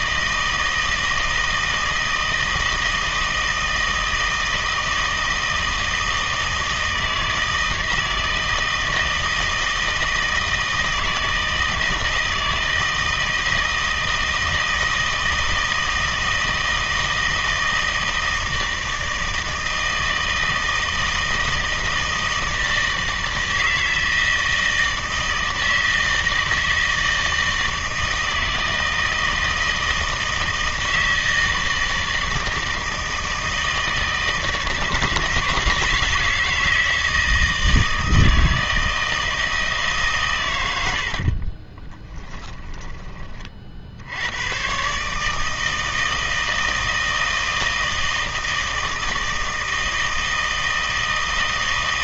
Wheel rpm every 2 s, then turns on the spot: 160, 160, 160, 160, 160, 160, 160, 160, 160, 160, 160, 160, 160, 160, 160, 160, 160, 160, 160, 160, 90, 10, 120, 160, 160, 160.
42-44